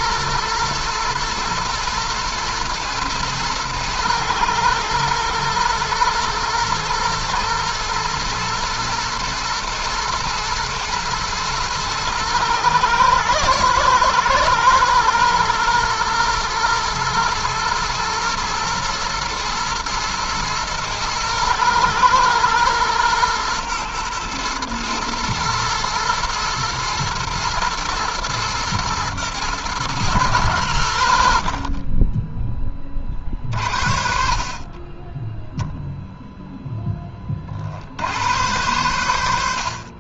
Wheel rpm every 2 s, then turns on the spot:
110, 110, 110, 110, 120, 110, 110, 120, 110, 110, 110, 110, 110, 110, 110, 70, 20, 20, 10, 100.
none